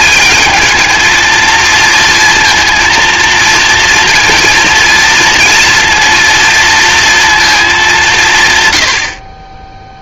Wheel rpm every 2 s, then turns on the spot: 220, 230, 230, 230, 110.
none